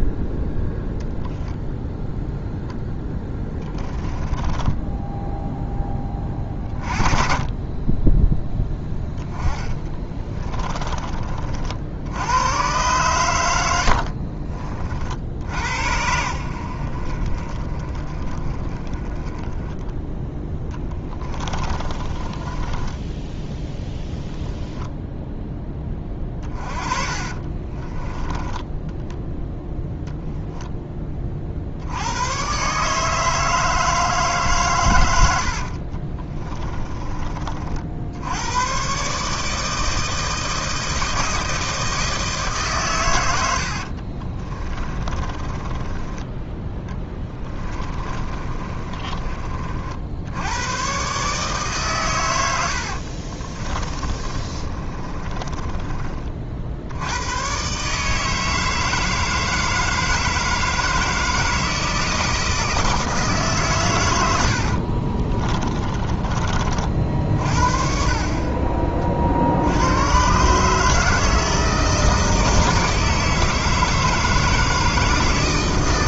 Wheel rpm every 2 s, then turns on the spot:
0, 10, 10, 30, 10, 20, 120, 40, 60, 20, 10, 20, 0, 30, 10, 10, 140, 120, 20, 110, 160, 140, 30, 20, 30, 110, 80, 30, 70, 160, 160, 160, 60, 40, 40, 150, 160, 160.
4-6 8-12 20-24 26-30 36-38 44-46 48-50 52-56 64-66